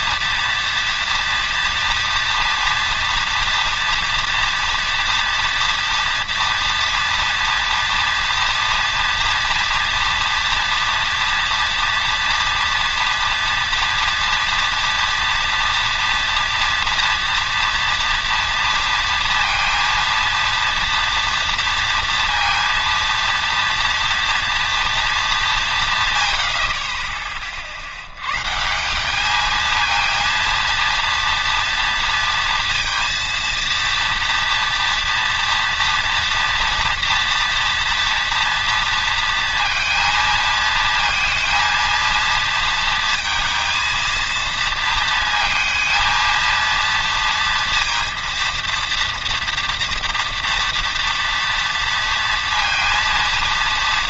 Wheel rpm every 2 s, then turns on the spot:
230, 230, 230, 240, 230, 230, 230, 230, 230, 230, 240, 230, 230, 30, 170, 230, 230, 230, 230, 230, 230, 230, 230, 230, 230, 230, 230.
none